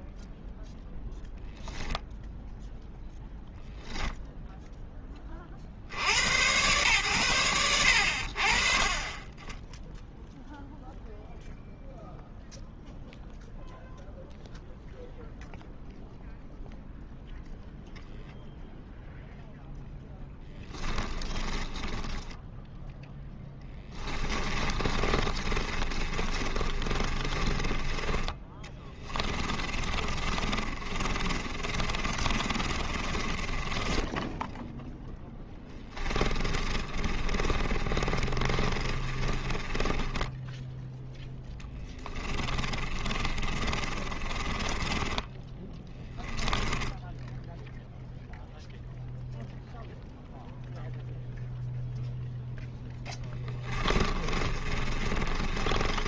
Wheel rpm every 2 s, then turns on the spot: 0, 0, 10, 120, 30, 0, 0, 0, 0, 0, 10, 0, 30, 30, 20, 30, 30, 10, 30, 20, 0, 30, 20, 10, 0, 0, 10, 30.
20-22 24-34 36-40 42-48 54-56